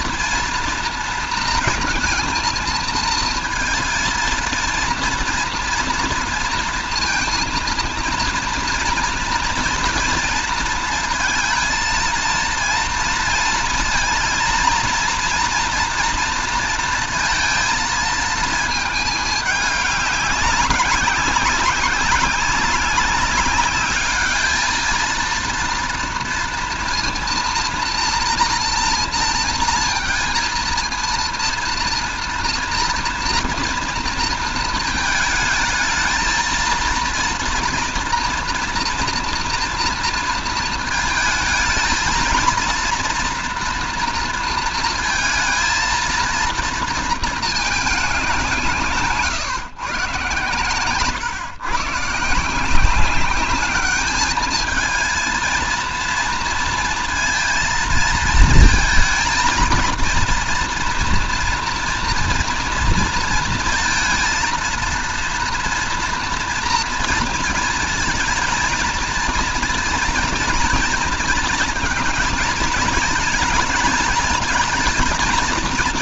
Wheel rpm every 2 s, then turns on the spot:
230, 220, 220, 230, 230, 230, 230, 230, 230, 220, 200, 200, 220, 240, 240, 230, 230, 220, 230, 230, 230, 230, 230, 230, 180, 120, 160, 220, 230, 230, 230, 230, 230, 230, 230, 230, 220, 220.
none